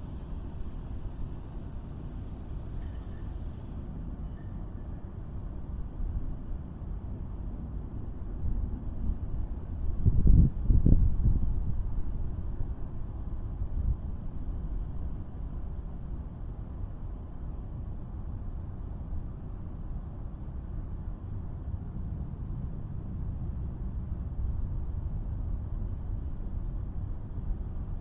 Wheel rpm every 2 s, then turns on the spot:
0, 0, 0, 0, 0, 0, 0, 0, 0, 0, 0, 0, 0, 0.
none